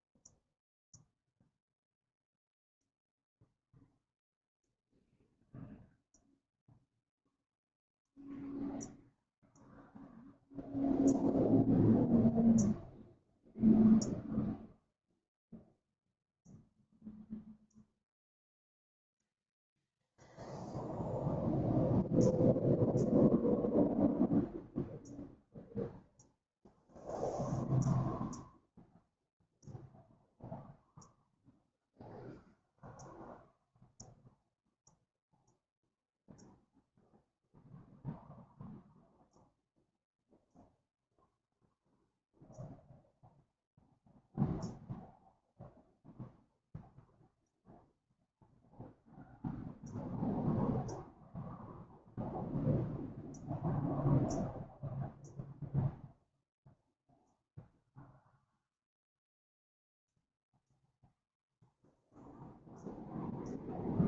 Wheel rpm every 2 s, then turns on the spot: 0, 0, 0, 0, 0, 0, 0, 0, 0, 0, 0, 0, 0, 0, 0, 0, 0, 0, 0, 0, 0, 0, 0, 0, 0, 0, 0, 0, 0, 0, 0, 0.
none